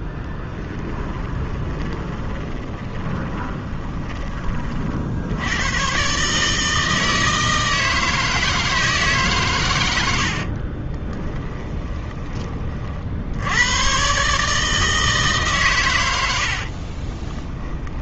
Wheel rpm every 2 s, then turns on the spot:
20, 20, 50, 160, 160, 40, 50, 160, 40.
0-4 10-12 16-18